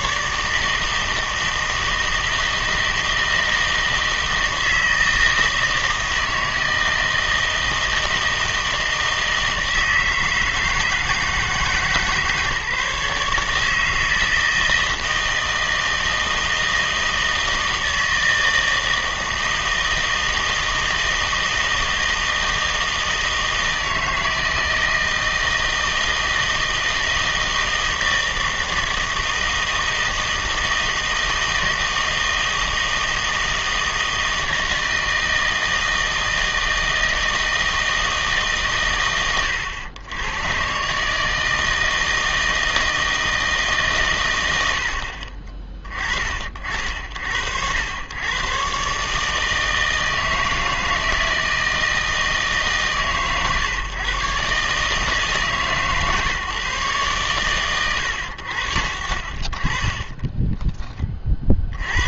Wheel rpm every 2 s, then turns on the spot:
160, 160, 160, 160, 160, 160, 150, 160, 160, 160, 160, 160, 160, 160, 160, 160, 160, 160, 160, 140, 130, 160, 90, 60, 130, 160, 150, 150, 140, 60, 20.
none